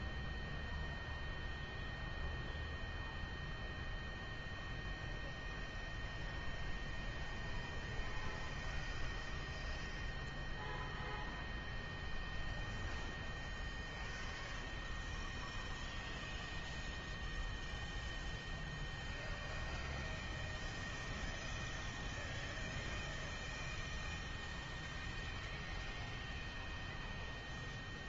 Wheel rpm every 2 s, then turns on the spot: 0, 0, 0, 0, 0, 0, 0, 0, 0, 0, 0, 0, 0, 0.
none